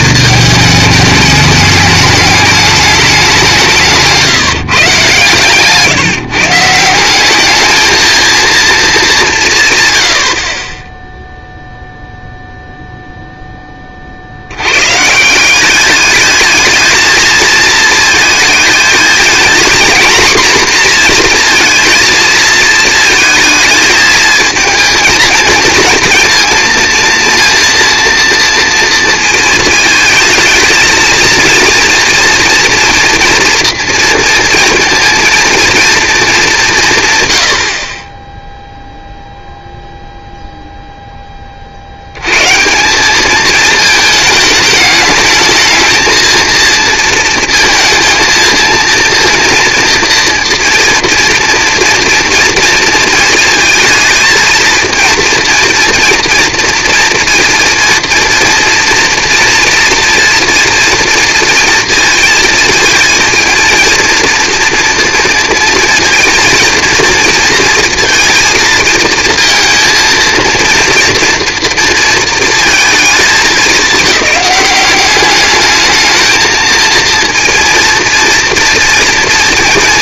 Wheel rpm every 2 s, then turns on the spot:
220, 210, 150, 160, 230, 40, 0, 100, 220, 220, 240, 230, 220, 230, 230, 220, 240, 230, 190, 0, 0, 150, 210, 230, 230, 230, 230, 230, 230, 230, 230, 220, 230, 230, 230, 230, 230, 200, 220, 230.
none